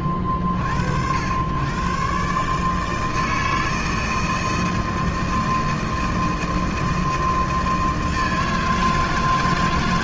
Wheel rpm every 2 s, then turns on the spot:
50, 140, 160, 160, 160.
none